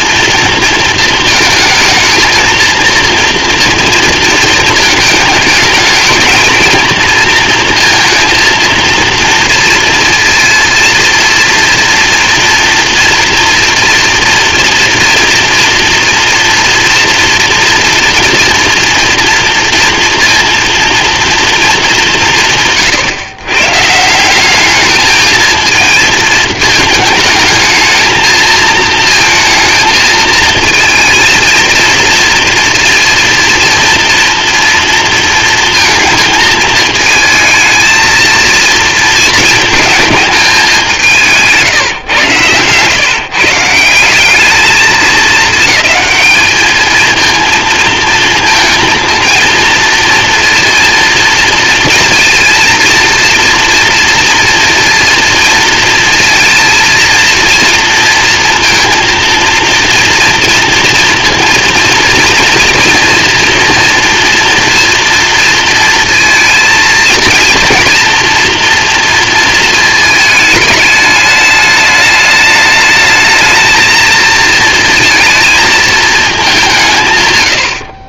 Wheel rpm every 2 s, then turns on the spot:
230, 230, 220, 230, 230, 230, 230, 230, 230, 230, 230, 130, 220, 220, 230, 230, 230, 230, 220, 220, 170, 140, 220, 220, 230, 230, 230, 230, 230, 230, 230, 240, 230, 230, 230, 210, 220, 220, 110.
none